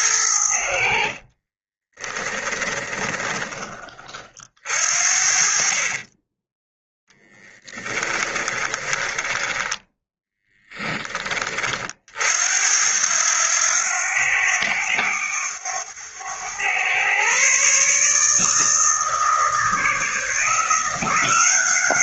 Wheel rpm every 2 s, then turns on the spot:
50, 20, 50, 10, 10, 10, 80, 100, 120, 160, 170.
0-4 8-10